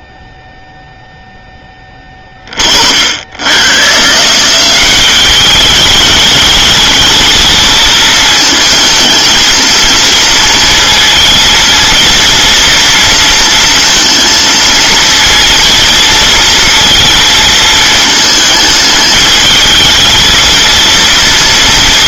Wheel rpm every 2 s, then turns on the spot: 0, 30, 160, 210, 220, 220, 230, 230, 230, 220, 220.
none